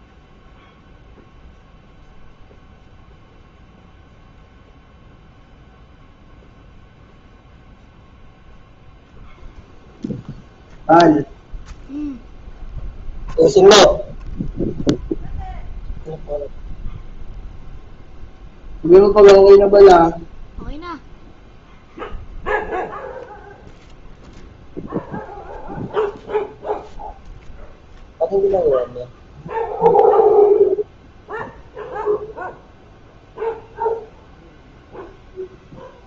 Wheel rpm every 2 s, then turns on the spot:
0, 0, 0, 0, 0, 0, 0, 0, 0, 0, 0, 0, 0, 0, 0, 0, 0, 0.
none